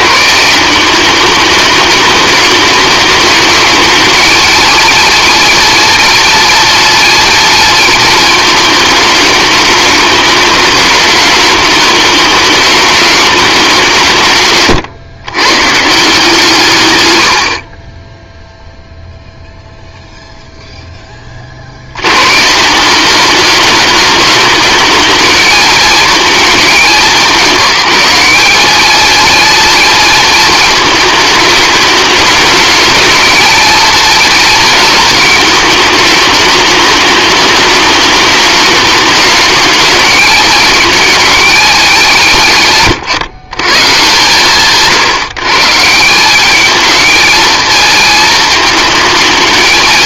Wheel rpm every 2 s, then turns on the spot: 180, 210, 230, 230, 220, 210, 210, 130, 130, 0, 10, 170, 220, 200, 220, 220, 220, 220, 210, 210, 220, 140, 150, 210, 220.
none